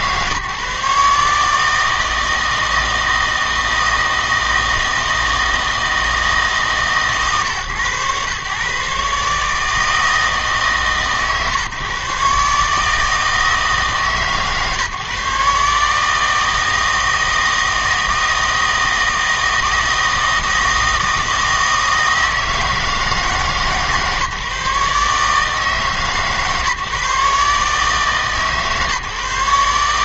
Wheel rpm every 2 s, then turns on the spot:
140, 160, 160, 160, 130, 150, 150, 150, 160, 160, 160, 160, 150, 140, 150.
none